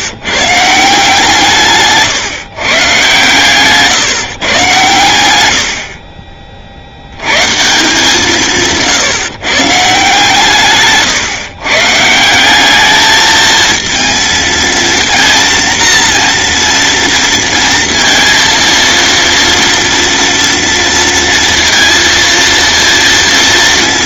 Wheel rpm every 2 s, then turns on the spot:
160, 130, 120, 60, 160, 140, 210, 230, 230, 230, 230, 230.
none